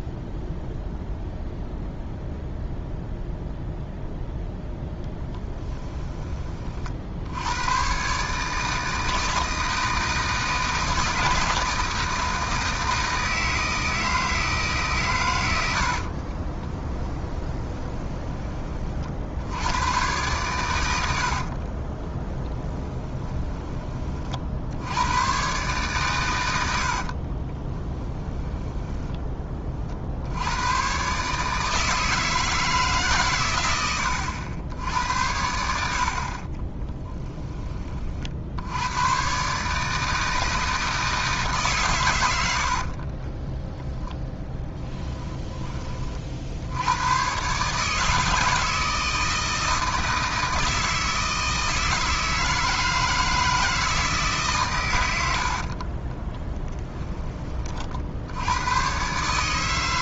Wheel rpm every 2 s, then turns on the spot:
0, 0, 0, 40, 160, 160, 160, 150, 30, 30, 100, 10, 70, 80, 10, 110, 150, 80, 30, 80, 160, 50, 10, 80, 160, 160, 160, 130, 10, 100.
16-18 28-30 36-38 42-46 56-58